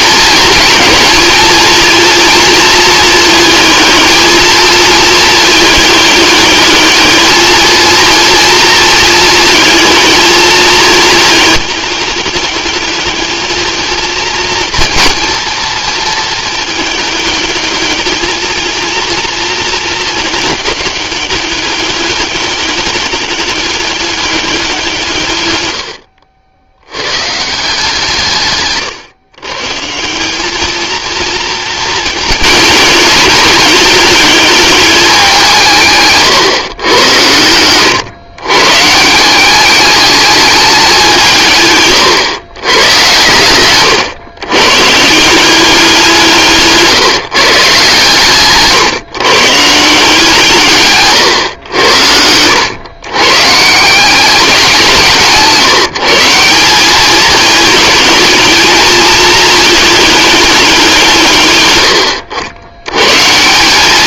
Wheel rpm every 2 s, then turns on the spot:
220, 220, 220, 210, 230, 220, 210, 230, 210, 230, 210, 200, 160, 100, 130, 230, 210, 210, 110, 140, 200, 110, 150, 150, 150, 140, 120, 170, 200, 220, 180, 110.
46-48